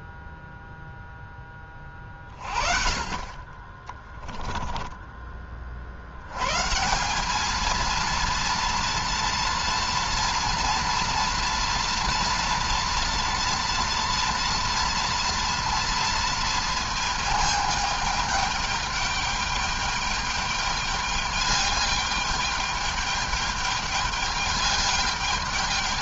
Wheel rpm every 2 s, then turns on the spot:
0, 40, 10, 170, 230, 230, 230, 230, 230, 210, 210, 210, 210.
none